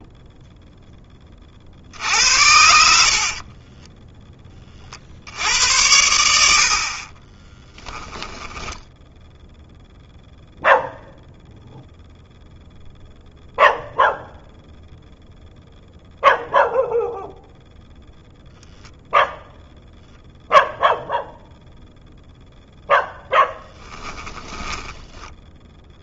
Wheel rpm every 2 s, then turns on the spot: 0, 80, 30, 60, 10, 0, 0, 0, 0, 0, 0, 0, 10.
8-10